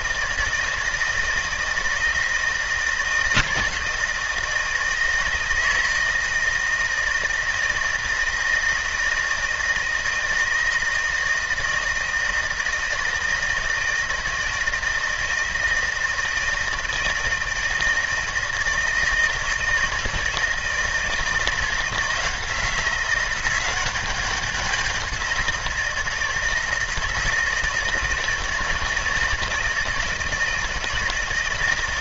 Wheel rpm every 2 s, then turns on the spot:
160, 160, 160, 160, 160, 160, 160, 160, 160, 160, 160, 180, 190, 160, 170, 160.
none